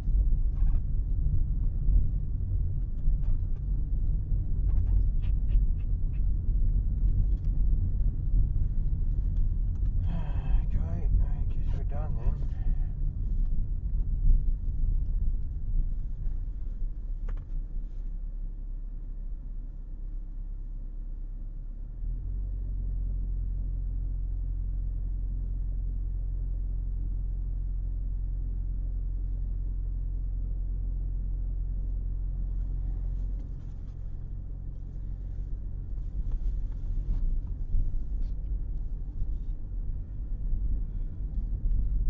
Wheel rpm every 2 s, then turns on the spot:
0, 0, 0, 0, 0, 0, 0, 0, 0, 0, 0, 0, 0, 0, 0, 0, 0, 0, 0, 0, 0.
none